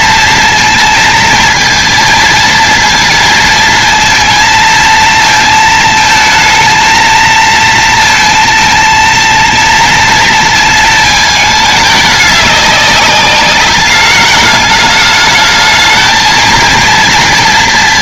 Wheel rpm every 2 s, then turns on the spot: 230, 230, 220, 230, 230, 220, 200, 210, 230.
none